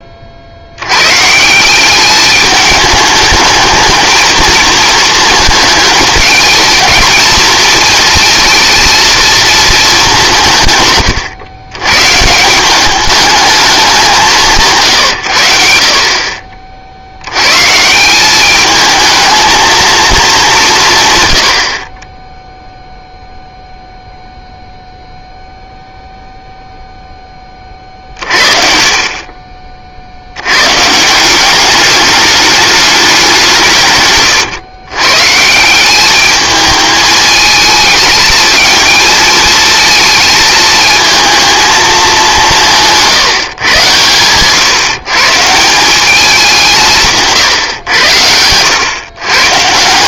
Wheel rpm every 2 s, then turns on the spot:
80, 210, 220, 220, 230, 140, 180, 140, 50, 210, 170, 0, 0, 0, 50, 120, 210, 130, 220, 230, 220, 180, 130, 170, 100.
none